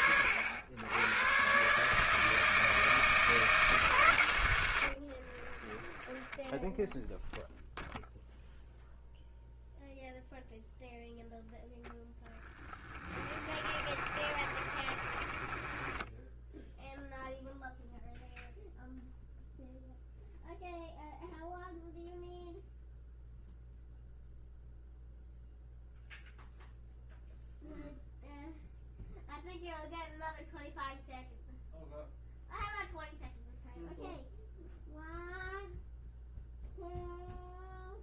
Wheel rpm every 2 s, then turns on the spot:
90, 160, 70, 0, 0, 0, 20, 30, 0, 0, 0, 0, 0, 0, 0, 0, 0, 0, 0.
4-6 12-16